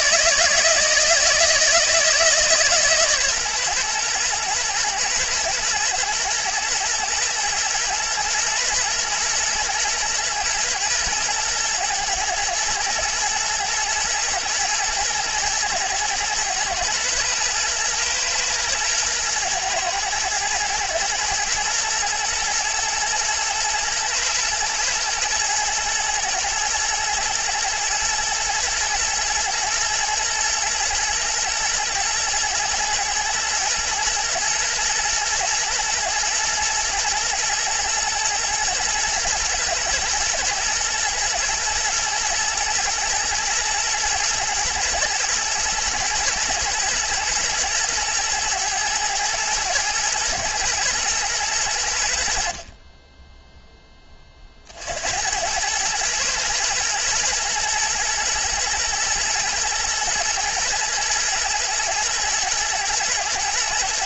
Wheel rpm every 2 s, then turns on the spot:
170, 140, 120, 110, 120, 120, 110, 120, 120, 110, 110, 110, 110, 110, 120, 110, 110, 110, 120, 110, 110, 110, 110, 110, 110, 110, 10, 70, 120, 110, 110, 120.
none